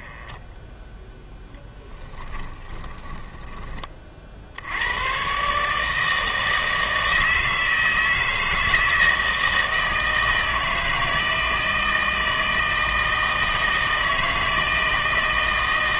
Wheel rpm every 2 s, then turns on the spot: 10, 20, 80, 160, 160, 160, 160, 160.
0-4